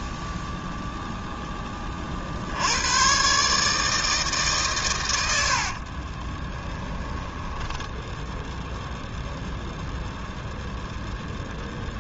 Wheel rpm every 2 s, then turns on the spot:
0, 100, 110, 10, 0, 0.
6-8